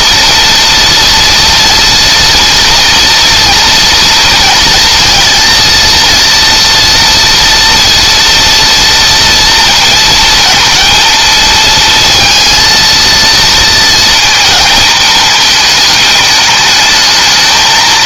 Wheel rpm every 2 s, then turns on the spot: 230, 240, 230, 230, 230, 230, 230, 220, 210.
none